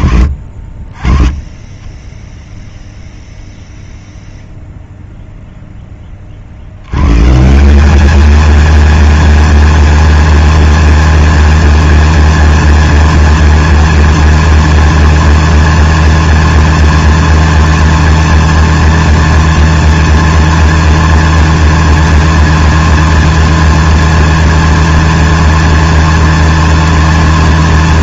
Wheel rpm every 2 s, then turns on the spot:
20, 0, 0, 120, 230, 230, 230, 230, 230, 230, 230, 230, 230, 230.
none